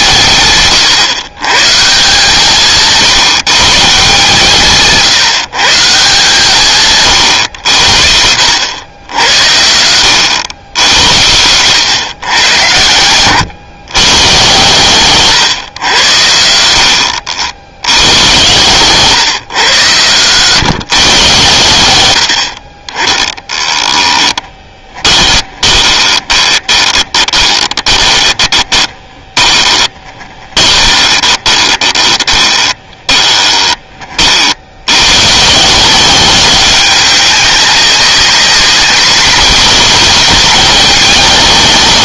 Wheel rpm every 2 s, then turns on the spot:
140, 160, 150, 150, 80, 90, 110, 120, 80, 120, 130, 50, 10, 20, 20, 20, 20, 60, 190, 190, 200.
24-34